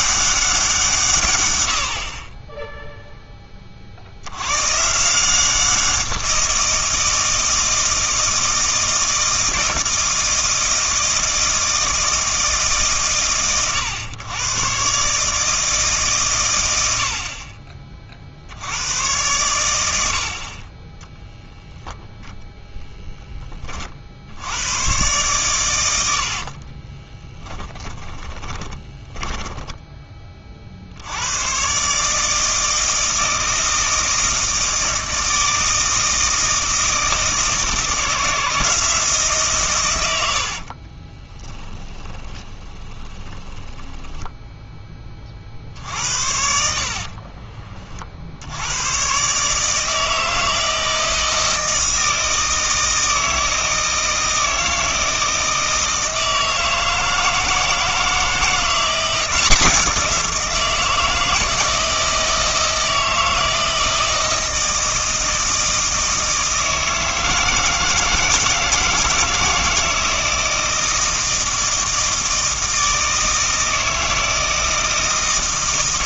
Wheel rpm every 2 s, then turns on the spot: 170, 0, 130, 170, 160, 160, 150, 130, 90, 90, 20, 0, 100, 40, 30, 50, 160, 160, 160, 160, 50, 20, 10, 50, 90, 160, 160, 160, 160, 180, 170, 160, 160, 160, 160, 160, 160, 160.
26-30 40-44 46-48